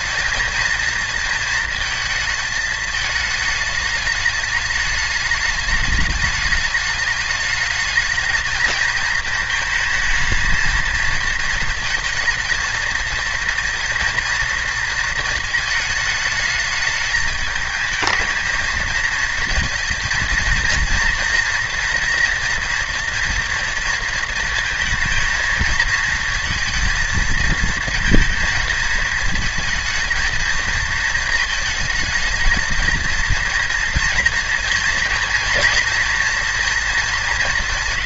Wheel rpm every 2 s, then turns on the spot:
220, 220, 210, 210, 220, 220, 230, 230, 220, 220, 230, 240, 230, 220, 220, 220, 230, 230, 220.
none